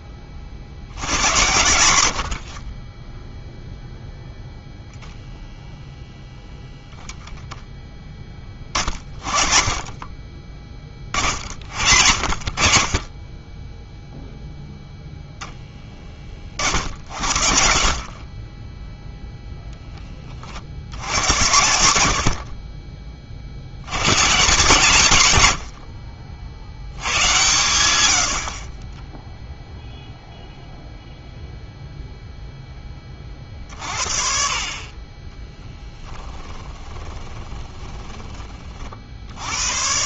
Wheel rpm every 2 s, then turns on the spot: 70, 30, 0, 0, 30, 30, 50, 0, 50, 10, 60, 40, 170, 80, 40, 0, 10, 40, 20, 30.
36-38